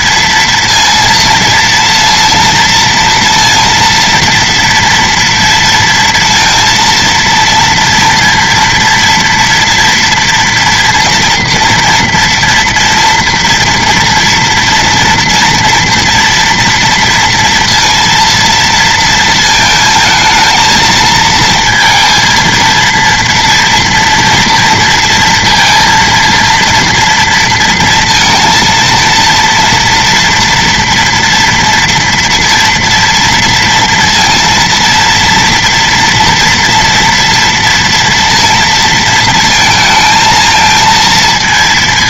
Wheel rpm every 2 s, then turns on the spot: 230, 230, 230, 230, 230, 240, 240, 230, 230, 230, 230, 230, 230, 230, 230, 230, 230, 230, 230, 230, 230.
none